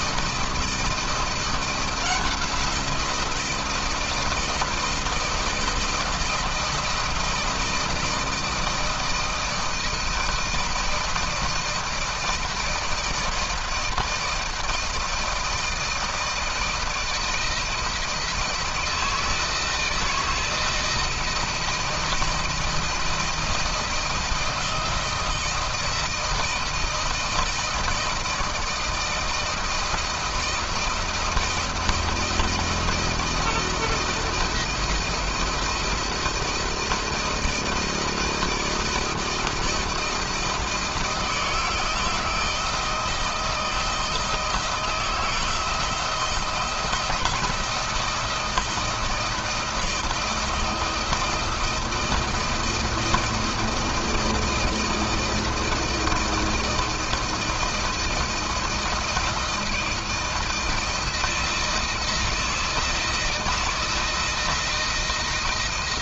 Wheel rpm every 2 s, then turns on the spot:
170, 170, 160, 170, 160, 160, 160, 160, 160, 160, 160, 160, 170, 170, 160, 170, 160, 160, 160, 160, 160, 160, 160, 160, 160, 160, 160, 160, 160, 160, 160, 160, 160.
none